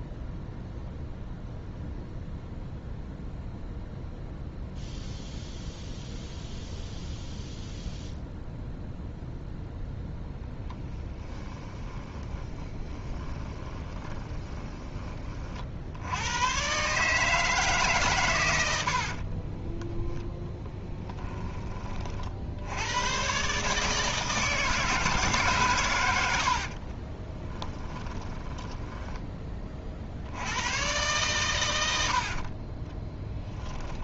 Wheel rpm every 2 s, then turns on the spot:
0, 0, 0, 0, 0, 10, 20, 20, 120, 80, 10, 90, 160, 50, 10, 110, 30.
10-16 20-22 26-30 32-34